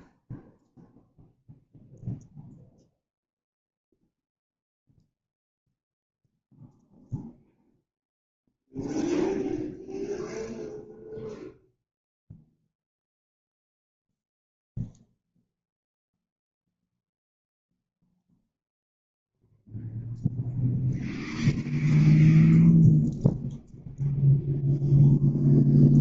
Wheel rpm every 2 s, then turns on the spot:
0, 0, 0, 0, 0, 0, 0, 0, 0, 0, 0, 0, 0.
none